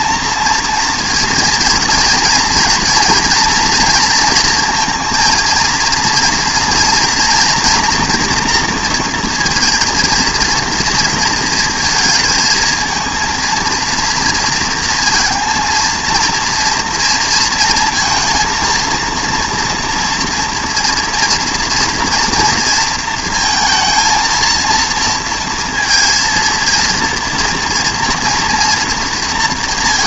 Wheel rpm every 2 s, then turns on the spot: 230, 230, 230, 230, 230, 230, 230, 230, 230, 230, 230, 230, 230, 230, 230.
none